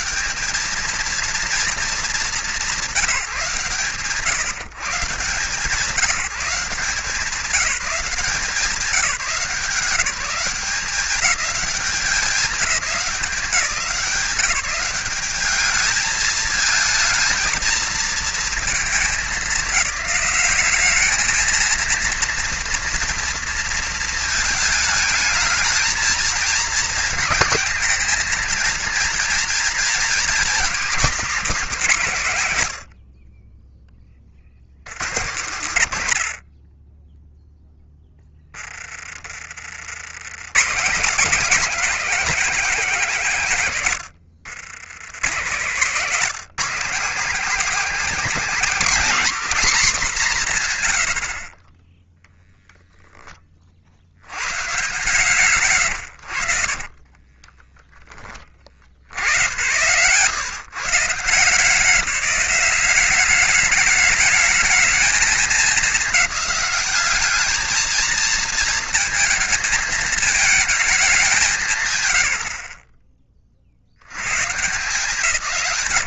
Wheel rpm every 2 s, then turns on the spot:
220, 170, 150, 180, 170, 190, 200, 200, 230, 210, 210, 230, 220, 220, 230, 250, 60, 90, 10, 20, 170, 190, 100, 230, 240, 70, 10, 140, 20, 70, 160, 190, 220, 210, 220, 210, 40, 170.
56-58